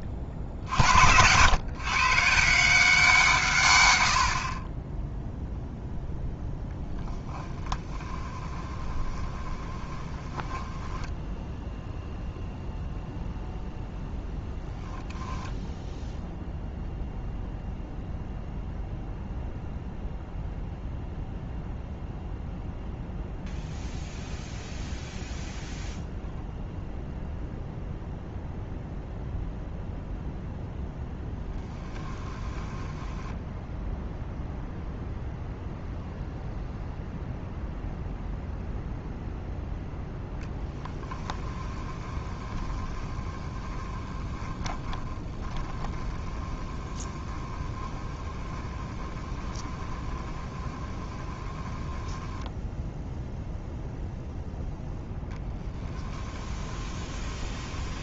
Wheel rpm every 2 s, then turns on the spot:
80, 170, 40, 0, 20, 10, 0, 0, 0, 0, 0, 0, 0, 0, 0, 0, 10, 0, 0, 0, 10, 20, 20, 20, 20, 20, 10, 0, 10.
8-12 32-34 40-54 56-58